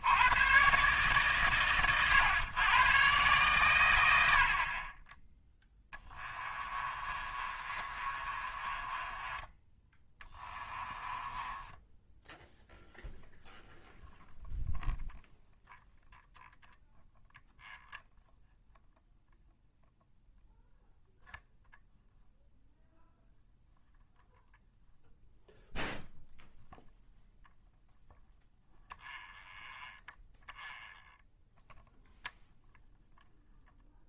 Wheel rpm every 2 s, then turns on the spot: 140, 120, 40, 30, 20, 20, 0, 0, 0, 0, 0, 0, 0, 0, 0, 0, 0.
6-12